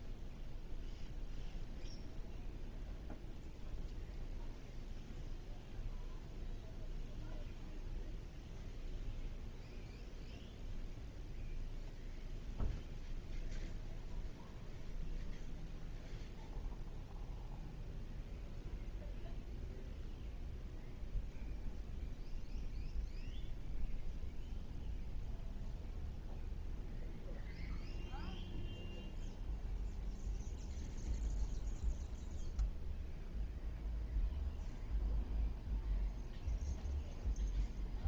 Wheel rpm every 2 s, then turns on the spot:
0, 0, 0, 0, 0, 0, 0, 0, 0, 0, 0, 0, 0, 0, 0, 0, 0, 0, 0.
none